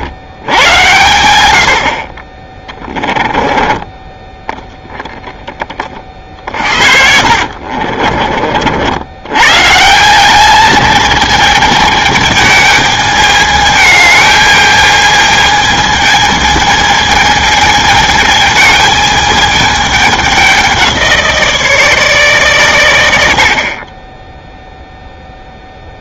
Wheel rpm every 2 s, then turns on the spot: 100, 20, 10, 60, 80, 220, 210, 220, 220, 220, 180, 110, 0.
2-4 6-8